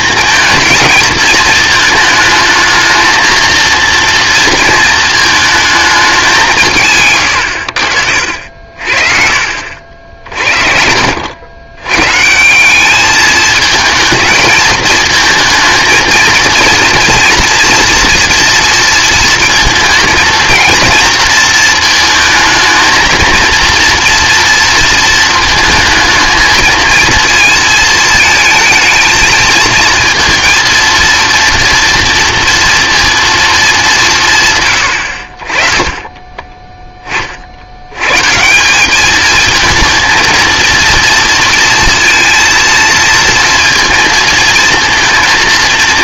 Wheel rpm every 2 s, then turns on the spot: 220, 220, 230, 160, 50, 60, 190, 220, 240, 230, 230, 220, 230, 220, 220, 230, 230, 130, 20, 190, 230, 230, 220.
none